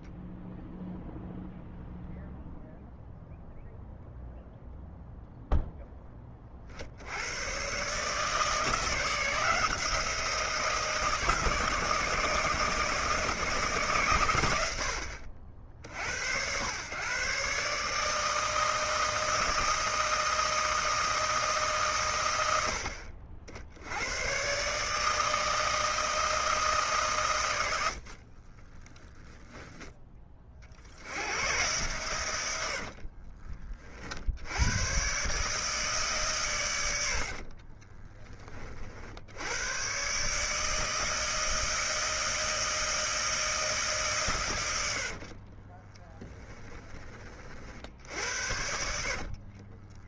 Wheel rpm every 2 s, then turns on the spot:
0, 0, 0, 40, 160, 170, 160, 90, 100, 160, 160, 100, 130, 160, 30, 30, 90, 100, 120, 40, 150, 160, 110, 20, 70.
28-30 46-50